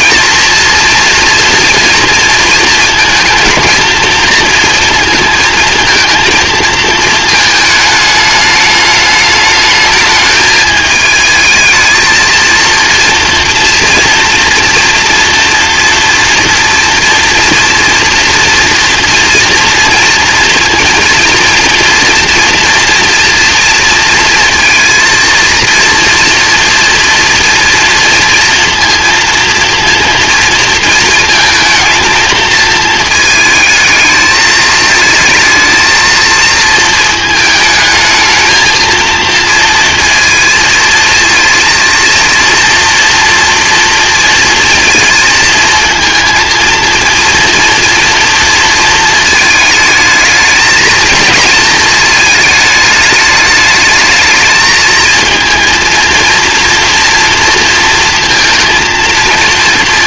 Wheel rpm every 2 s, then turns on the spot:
240, 230, 230, 230, 210, 210, 230, 230, 240, 230, 230, 230, 230, 230, 230, 230, 220, 220, 230, 220, 230, 230, 230, 230, 230, 220, 210, 220, 230, 230.
none